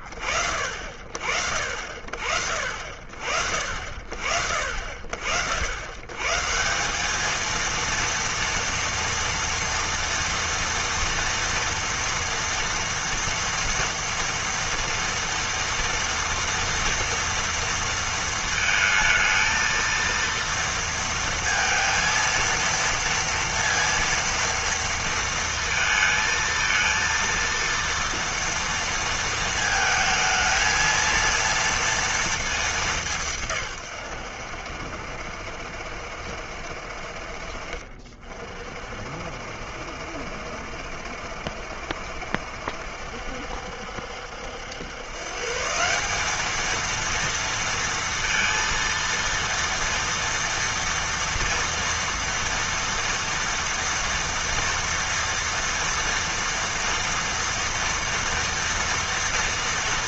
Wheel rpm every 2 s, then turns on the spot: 50, 50, 50, 140, 230, 230, 230, 230, 230, 220, 230, 230, 230, 220, 230, 220, 220, 80, 60, 50, 70, 70, 80, 200, 230, 230, 230, 230, 230, 230.
none